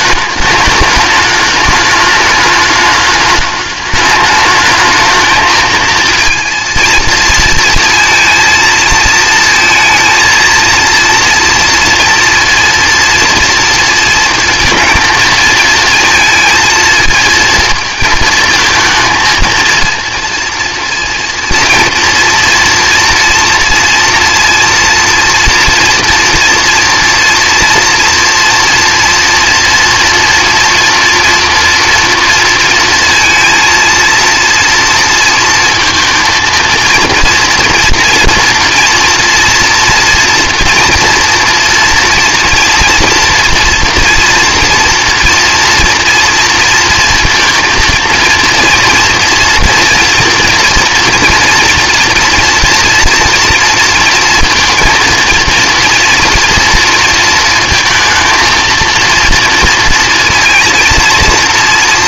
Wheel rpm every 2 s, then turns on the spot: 210, 210, 220, 230, 230, 230, 230, 230, 230, 230, 230, 230, 230, 230, 240, 230, 230, 230, 230, 230, 240, 230, 240, 230, 230, 240, 230, 230, 230, 220, 230.
none